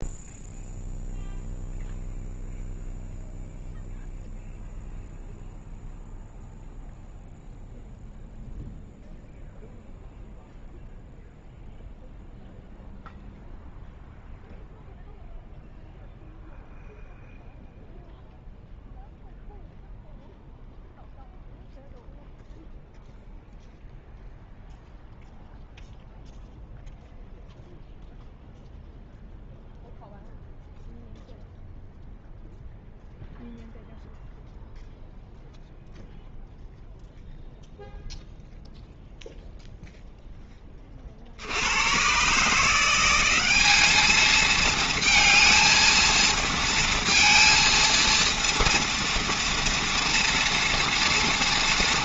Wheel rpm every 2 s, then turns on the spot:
0, 0, 0, 0, 0, 0, 0, 0, 0, 0, 0, 0, 0, 0, 0, 0, 0, 0, 0, 0, 20, 160, 230, 230, 230, 230.
none